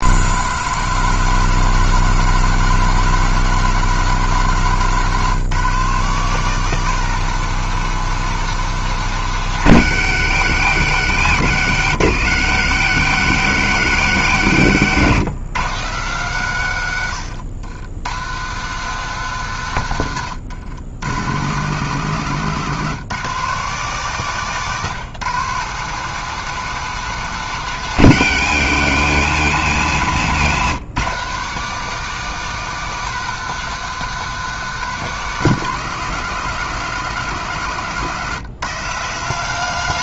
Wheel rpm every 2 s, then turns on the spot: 160, 160, 150, 170, 170, 120, 110, 110, 120, 150, 100, 150, 150, 170, 130, 120, 180, 170, 160, 150.
none